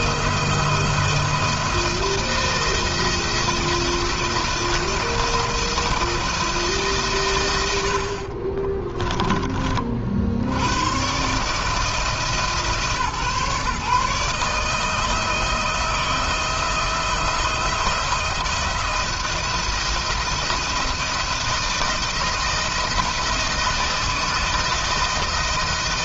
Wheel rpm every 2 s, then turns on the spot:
170, 170, 170, 150, 30, 110, 150, 150, 160, 170, 170, 160, 160.
8-10